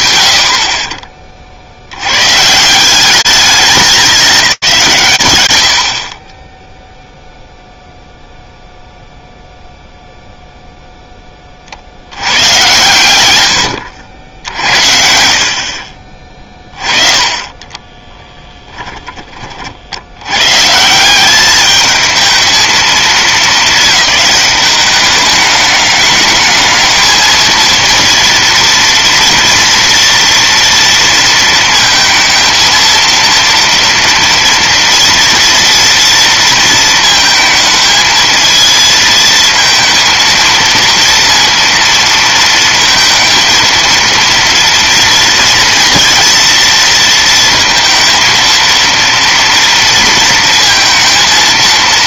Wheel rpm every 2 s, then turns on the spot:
60, 190, 140, 0, 0, 10, 110, 60, 30, 20, 170, 220, 200, 220, 230, 230, 230, 230, 230, 230, 230, 230, 230, 230, 230, 230.
12-14 16-18